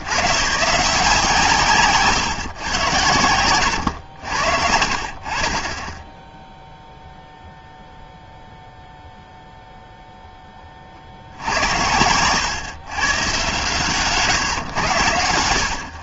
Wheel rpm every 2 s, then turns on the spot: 120, 120, 70, 0, 0, 20, 130, 120.
none